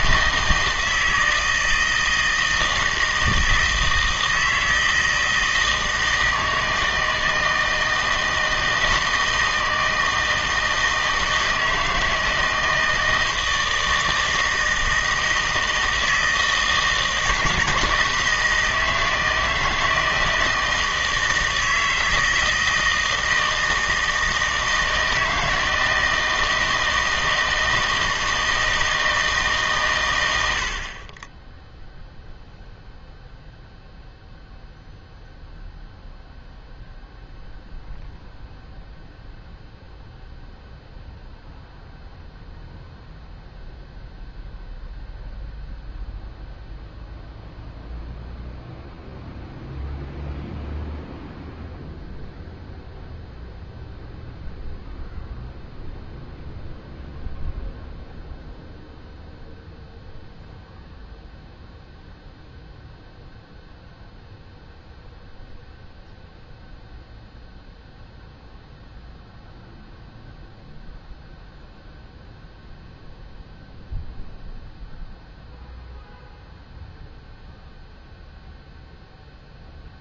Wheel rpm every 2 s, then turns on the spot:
160, 160, 160, 160, 160, 160, 160, 160, 160, 160, 160, 160, 160, 160, 160, 60, 0, 0, 0, 0, 0, 0, 0, 0, 0, 0, 0, 0, 0, 0, 0, 0, 0, 0, 0, 0, 0, 0, 0, 0.
none